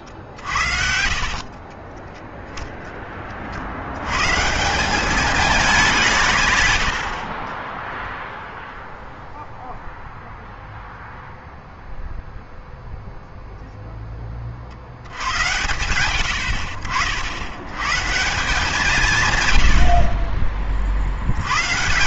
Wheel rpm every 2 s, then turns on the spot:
50, 10, 180, 110, 0, 0, 0, 50, 70, 170, 50.
none